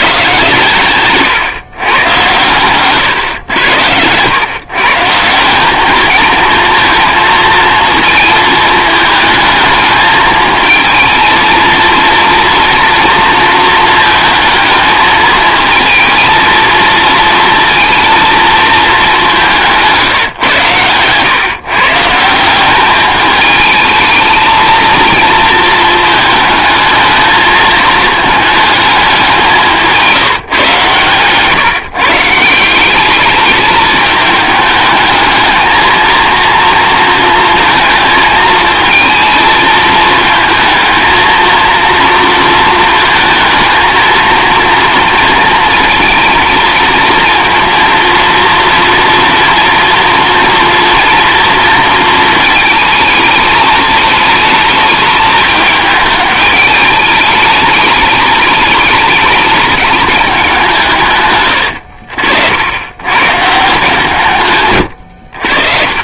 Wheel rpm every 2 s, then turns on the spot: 130, 130, 140, 230, 220, 220, 230, 220, 230, 220, 130, 190, 220, 220, 210, 140, 180, 210, 230, 220, 220, 230, 230, 230, 230, 230, 220, 220, 210, 210, 170, 90, 120.
30-32